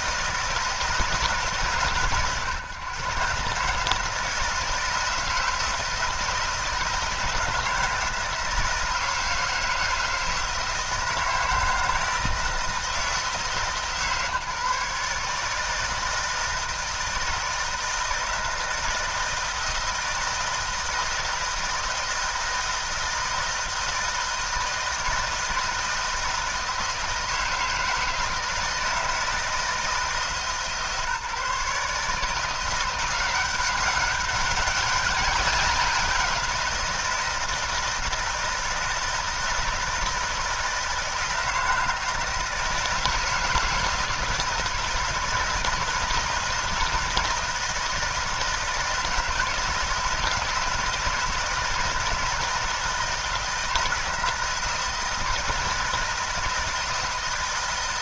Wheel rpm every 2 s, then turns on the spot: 160, 130, 160, 170, 160, 160, 160, 150, 160, 160, 160, 160, 160, 160, 160, 150, 180, 200, 170, 160, 160, 160, 160, 160, 160, 160, 160, 160, 160.
none